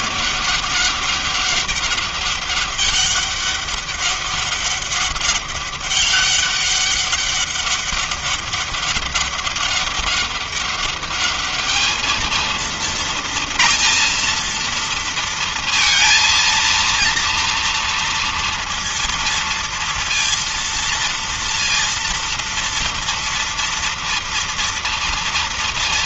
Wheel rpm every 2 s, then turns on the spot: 200, 200, 200, 200, 200, 200, 230, 230, 230, 230, 230, 230, 240.
none